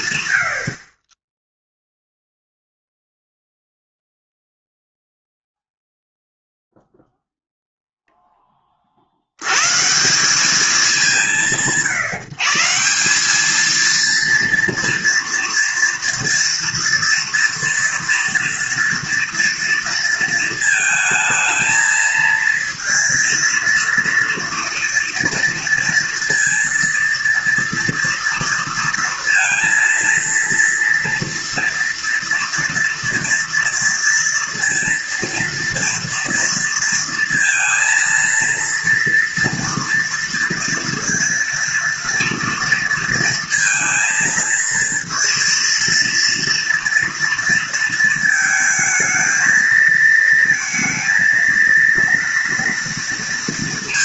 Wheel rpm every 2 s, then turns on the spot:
80, 0, 0, 0, 40, 180, 170, 230, 230, 240, 220, 230, 240, 230, 230, 230, 230, 230, 230, 230, 230, 230, 230, 230, 220, 230, 230.
none